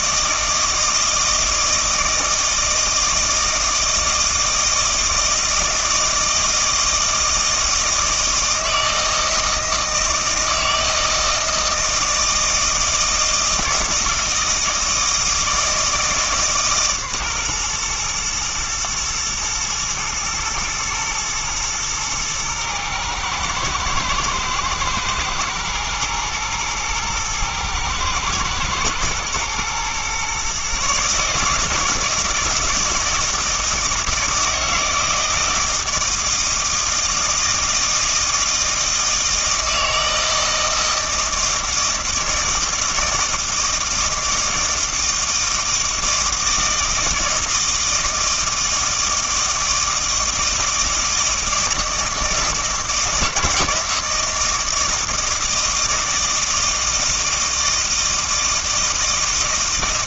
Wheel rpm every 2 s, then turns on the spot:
160, 160, 160, 160, 160, 160, 160, 160, 140, 120, 110, 110, 110, 110, 110, 140, 160, 160, 160, 160, 160, 160, 160, 160, 160, 160, 160, 160, 160, 160.
none